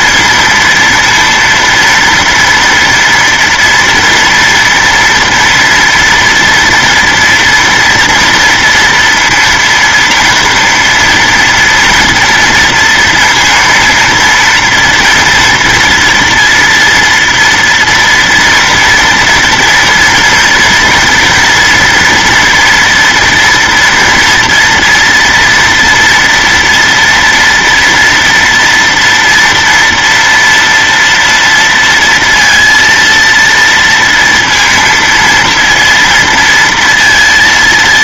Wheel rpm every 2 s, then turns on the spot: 230, 230, 230, 230, 240, 230, 230, 230, 230, 230, 230, 240, 230, 230, 230, 230, 230, 230, 230.
none